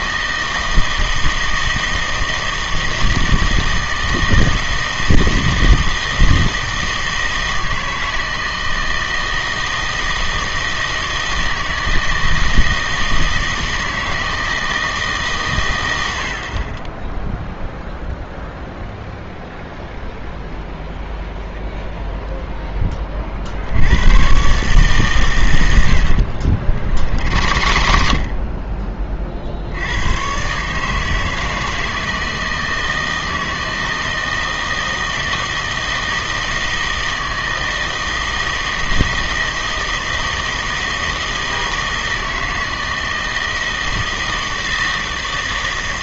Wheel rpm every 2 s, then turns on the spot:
160, 160, 160, 160, 160, 160, 160, 160, 40, 0, 0, 10, 130, 60, 40, 140, 160, 160, 160, 160, 160, 160, 160.
26-28